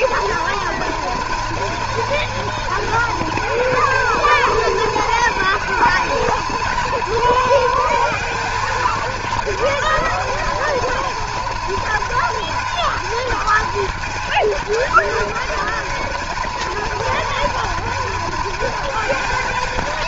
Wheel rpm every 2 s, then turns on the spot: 230, 230, 220, 230, 230, 240, 230, 240, 230, 230.
none